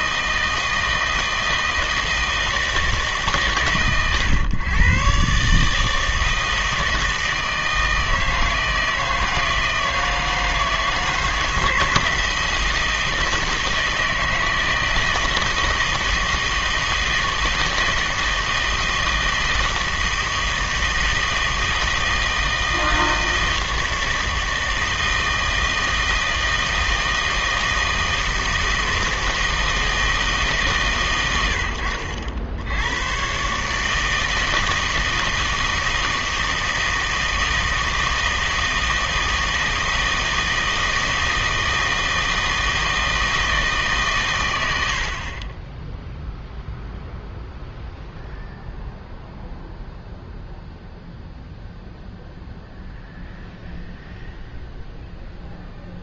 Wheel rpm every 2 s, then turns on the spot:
160, 160, 120, 160, 160, 160, 160, 160, 160, 160, 160, 160, 160, 160, 160, 140, 80, 160, 160, 160, 160, 160, 90, 0, 0, 0, 0, 0.
none